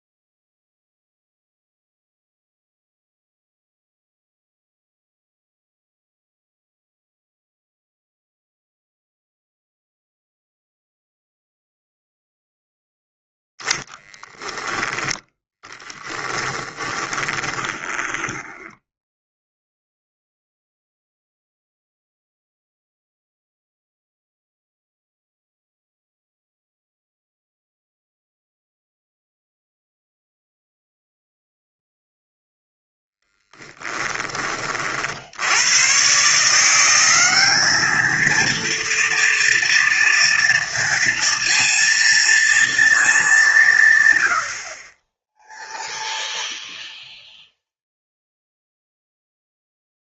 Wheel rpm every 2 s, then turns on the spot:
0, 0, 0, 0, 0, 0, 0, 10, 20, 10, 0, 0, 0, 0, 0, 0, 10, 40, 180, 230, 230, 230, 50, 0, 0.
16-20